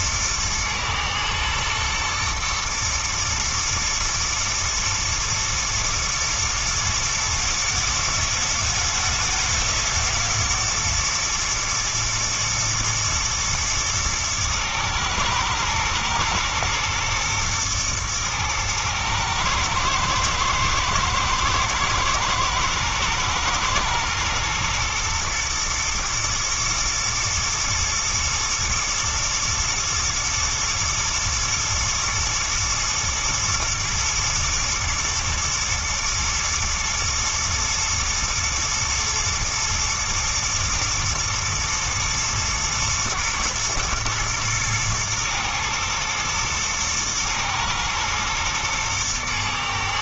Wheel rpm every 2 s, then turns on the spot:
110, 110, 110, 120, 110, 120, 120, 110, 110, 110, 110, 110, 120, 120, 110, 110, 120, 110, 110, 120, 110, 110, 110, 110, 110.
none